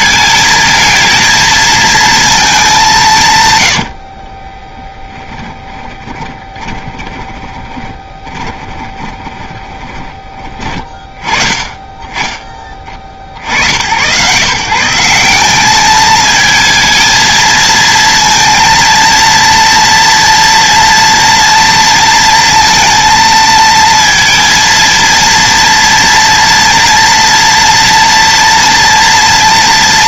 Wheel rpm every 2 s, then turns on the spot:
220, 160, 10, 20, 20, 30, 50, 170, 220, 230, 230, 230, 230, 230, 230.
4-10